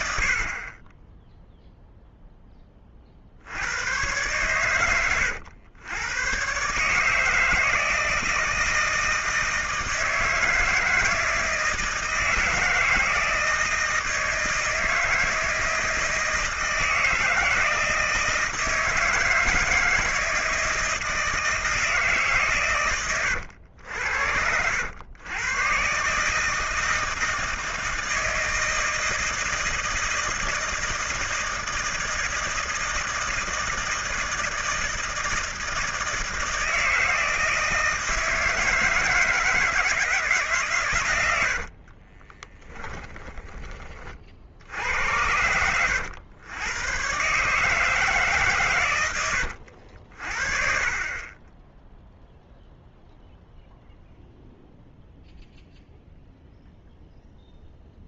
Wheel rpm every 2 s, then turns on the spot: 40, 10, 110, 130, 160, 160, 160, 160, 160, 160, 160, 130, 90, 150, 160, 160, 160, 160, 160, 160, 140, 20, 50, 100, 130, 40, 0, 0, 0.
42-44